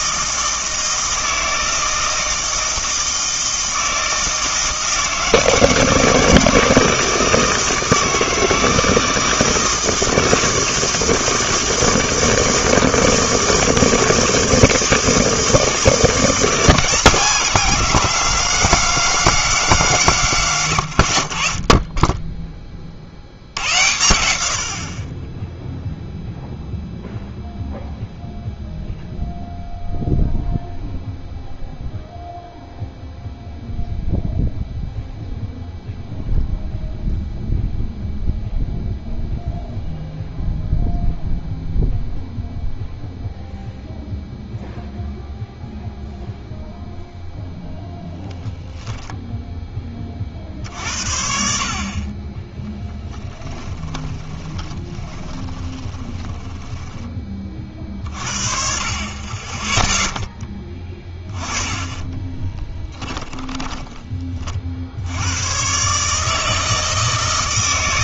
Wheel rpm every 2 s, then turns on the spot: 160, 160, 160, 160, 160, 160, 160, 160, 170, 190, 100, 30, 60, 0, 0, 0, 0, 0, 0, 0, 0, 0, 0, 0, 0, 60, 10, 20, 10, 40, 20, 10, 60, 160.
20-22 54-58 62-64